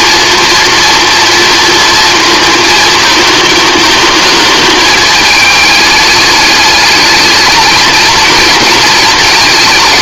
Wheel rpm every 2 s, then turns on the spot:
230, 230, 210, 210, 220.
none